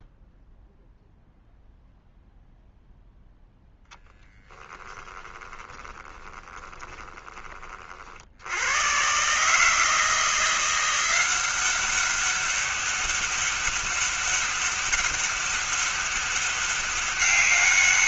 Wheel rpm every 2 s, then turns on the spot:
0, 0, 20, 20, 100, 170, 200, 200, 200.
4-8